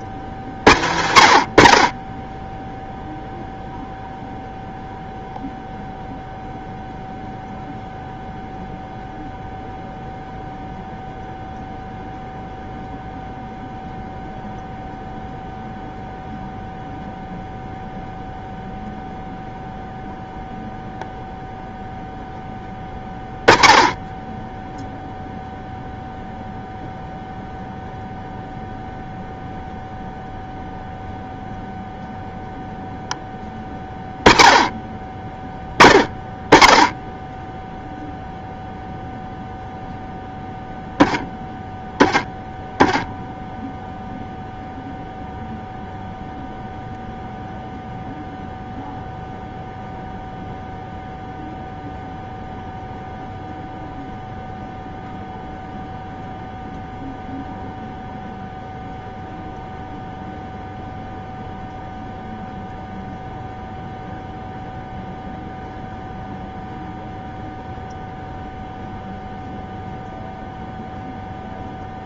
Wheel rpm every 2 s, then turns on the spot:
100, 0, 0, 0, 0, 0, 0, 0, 0, 0, 0, 10, 0, 0, 0, 0, 0, 30, 10, 0, 0, 10, 0, 0, 0, 0, 0, 0, 0, 0, 0, 0, 0, 0, 0, 0.
none